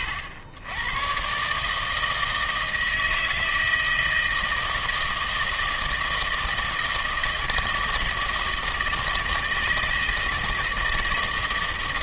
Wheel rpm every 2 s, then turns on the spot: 100, 160, 160, 160, 160, 160.
none